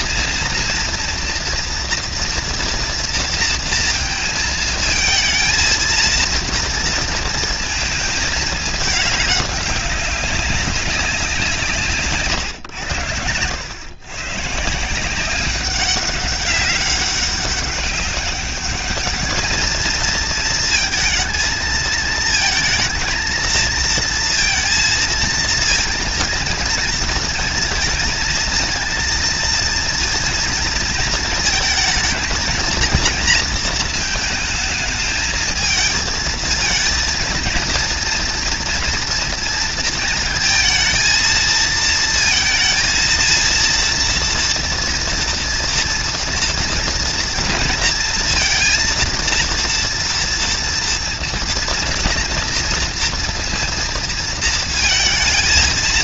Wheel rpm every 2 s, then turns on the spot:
230, 230, 220, 230, 210, 190, 100, 180, 200, 210, 220, 230, 230, 230, 230, 230, 230, 220, 230, 230, 220, 230, 230, 230, 230, 230, 230, 220.
none